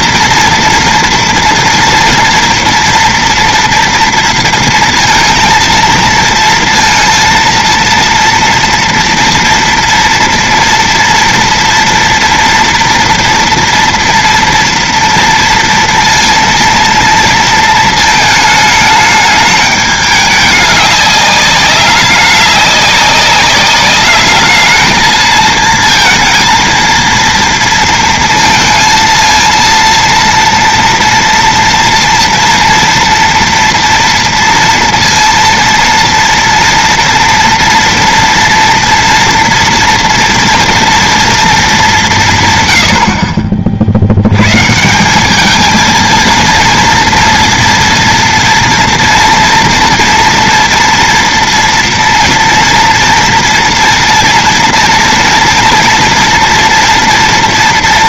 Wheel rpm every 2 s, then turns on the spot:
230, 230, 230, 230, 230, 230, 230, 230, 230, 220, 210, 200, 210, 230, 230, 230, 230, 230, 230, 240, 230, 150, 100, 220, 230, 230, 230, 230, 230.
none